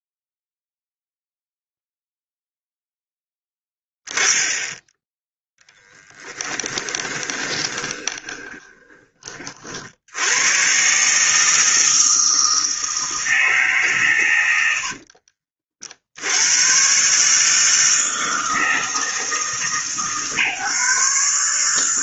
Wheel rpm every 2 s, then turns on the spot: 0, 0, 10, 20, 20, 120, 160, 80, 120, 160, 140.
6-10 14-16